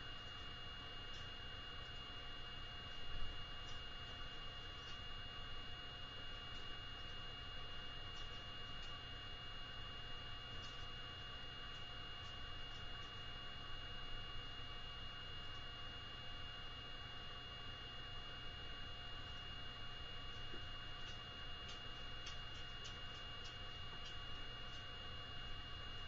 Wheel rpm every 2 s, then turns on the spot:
0, 0, 0, 0, 0, 0, 0, 0, 0, 0, 0, 0, 0.
none